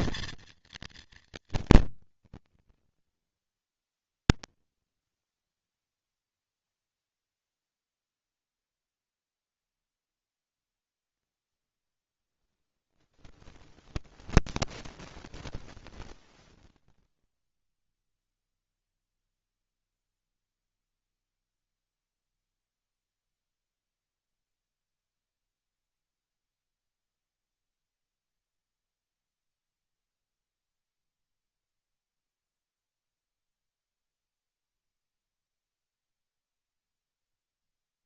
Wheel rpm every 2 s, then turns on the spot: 230, 230, 220, 60, 0, 0, 0, 0, 0, 0, 0, 0, 0, 0, 0, 0, 0, 0, 0.
none